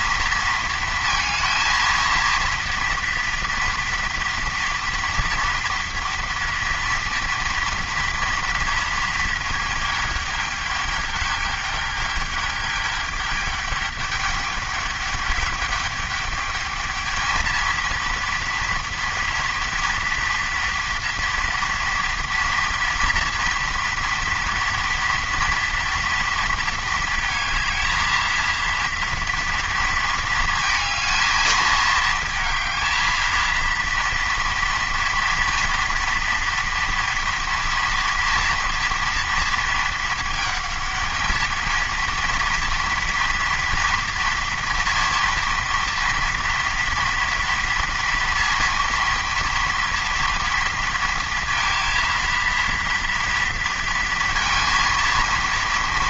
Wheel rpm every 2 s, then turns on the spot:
230, 230, 240, 230, 230, 210, 210, 210, 210, 230, 230, 240, 230, 230, 230, 220, 220, 230, 230, 230, 220, 230, 230, 240, 230, 230, 230, 230.
none